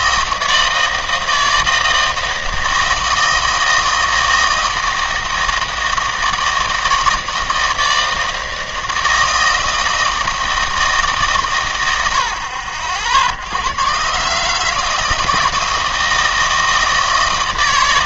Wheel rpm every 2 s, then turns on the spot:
160, 160, 160, 160, 160, 160, 50, 160, 160.
none